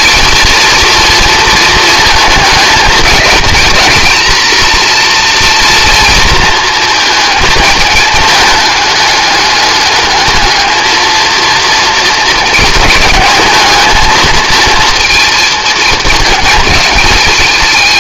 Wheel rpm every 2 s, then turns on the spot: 230, 220, 240, 220, 210, 220, 220, 230, 210.
none